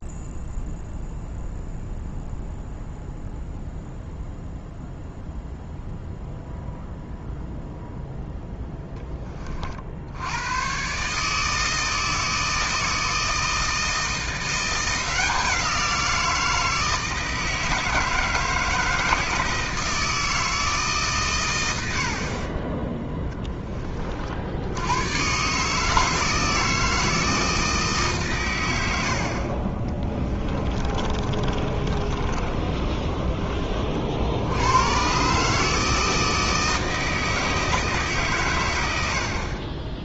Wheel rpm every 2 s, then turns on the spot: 0, 0, 0, 0, 10, 130, 160, 180, 160, 160, 150, 10, 110, 160, 90, 30, 30, 110, 160, 90.
30-34